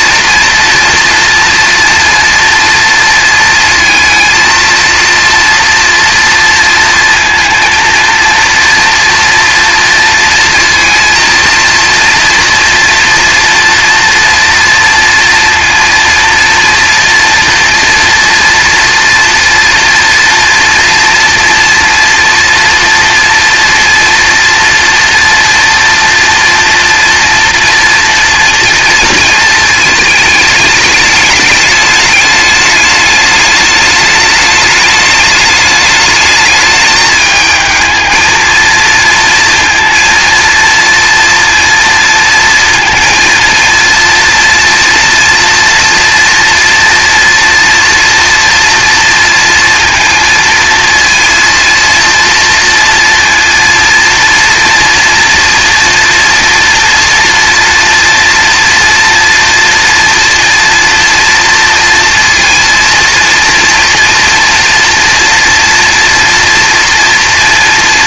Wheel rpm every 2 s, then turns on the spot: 230, 230, 230, 230, 240, 230, 240, 230, 230, 230, 230, 230, 230, 230, 230, 210, 210, 210, 210, 230, 230, 230, 230, 230, 230, 230, 230, 230, 230, 230, 240, 230, 230, 240.
none